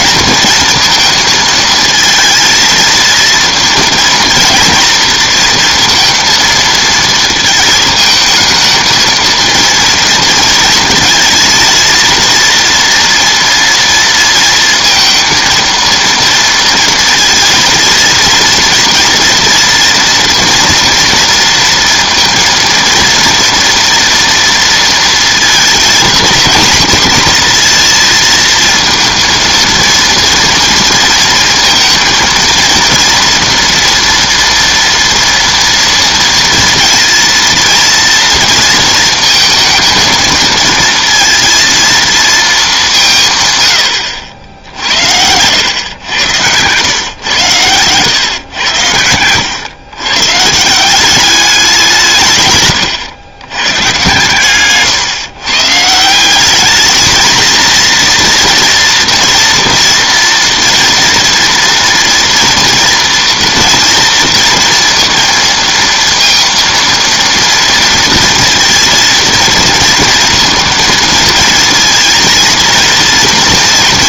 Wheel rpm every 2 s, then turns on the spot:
230, 230, 230, 230, 220, 230, 230, 230, 230, 230, 230, 230, 230, 240, 230, 230, 230, 240, 230, 230, 220, 220, 70, 100, 110, 150, 140, 120, 200, 230, 230, 240, 230, 230, 230, 230, 230.
none